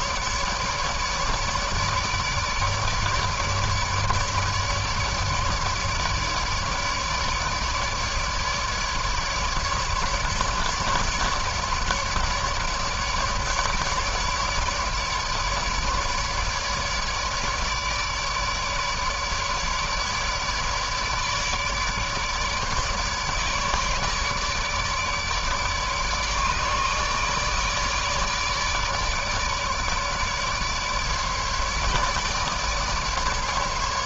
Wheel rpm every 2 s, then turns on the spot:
150, 150, 150, 150, 150, 150, 150, 150, 150, 150, 150, 150, 150, 150, 150, 150, 150.
none